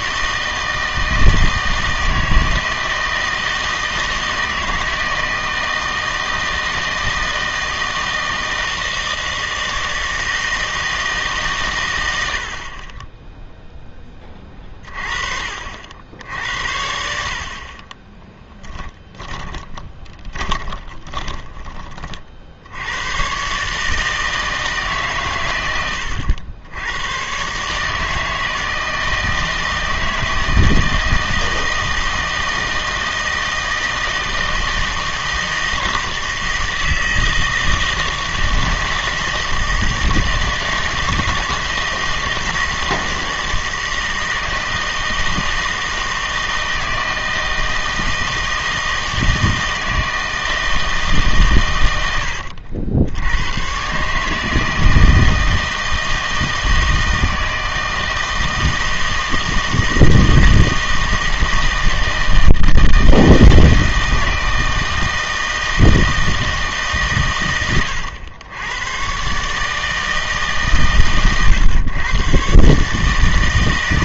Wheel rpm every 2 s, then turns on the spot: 160, 160, 160, 160, 160, 160, 50, 30, 70, 10, 20, 80, 150, 90, 160, 160, 160, 160, 160, 160, 160, 160, 160, 160, 160, 160, 80, 160, 160, 160, 160, 160, 160, 160, 110, 140, 140.
18-22